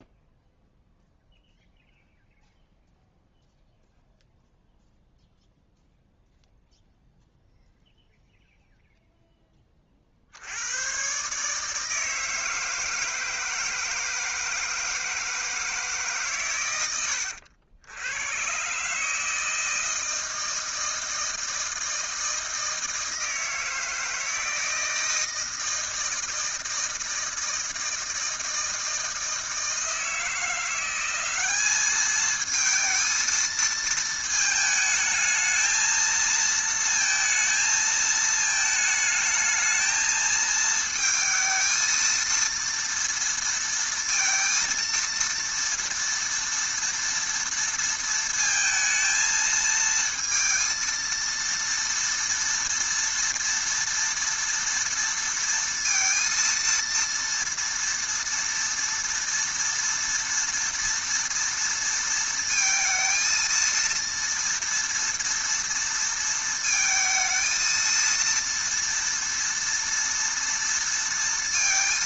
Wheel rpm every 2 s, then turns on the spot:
0, 0, 0, 0, 0, 130, 160, 160, 80, 150, 160, 160, 160, 160, 160, 190, 220, 220, 230, 220, 220, 230, 230, 230, 220, 230, 230, 230, 230, 230, 230, 230, 230, 220, 230, 230.
none